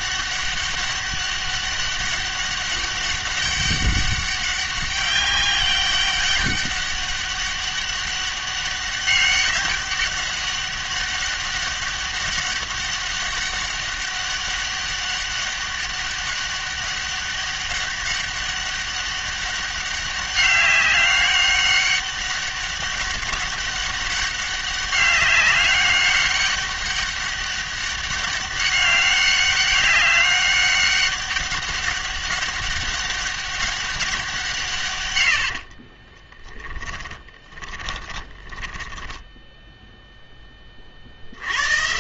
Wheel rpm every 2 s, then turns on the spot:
200, 200, 200, 200, 200, 200, 200, 200, 200, 200, 200, 200, 200, 200, 200, 200, 200, 140, 20, 10, 30.
36-40